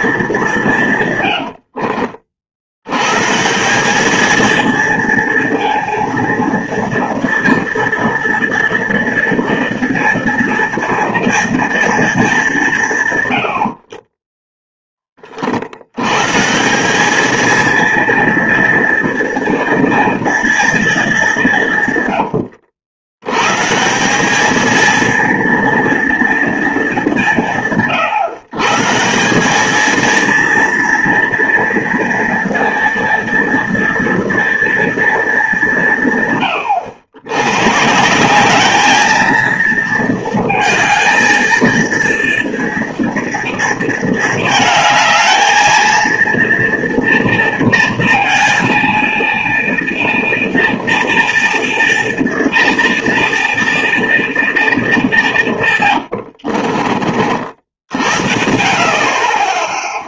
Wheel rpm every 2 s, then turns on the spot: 180, 80, 230, 230, 230, 230, 180, 10, 180, 230, 230, 100, 220, 220, 140, 230, 230, 230, 110, 200, 220, 230, 220, 230, 230, 240, 230, 220, 60, 50.
56-58